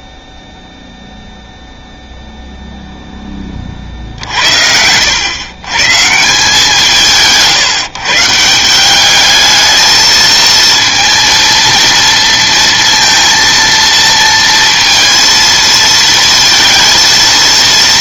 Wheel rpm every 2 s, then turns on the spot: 0, 0, 70, 170, 170, 230, 230, 230, 220.
none